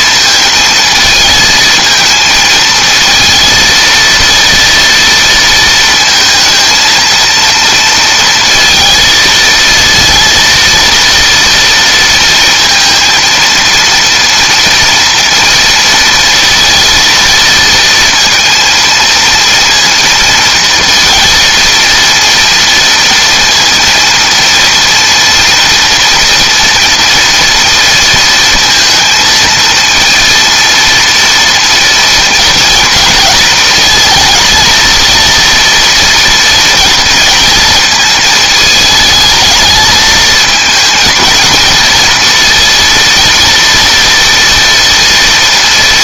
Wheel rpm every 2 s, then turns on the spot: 230, 220, 230, 220, 230, 230, 230, 230, 230, 230, 230, 230, 230, 230, 230, 230, 230, 220, 230, 220, 230, 230, 240.
none